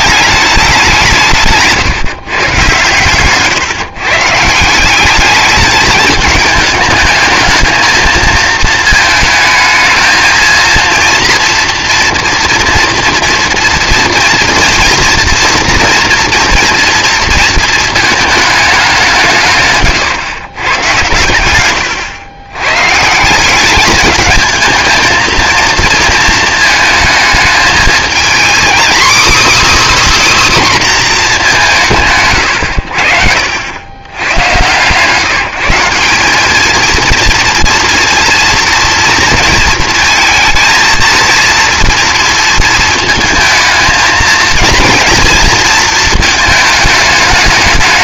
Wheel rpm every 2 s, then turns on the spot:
190, 130, 180, 210, 220, 230, 230, 240, 240, 200, 120, 130, 220, 220, 270, 270, 90, 130, 220, 240, 230, 220, 230, 210.
none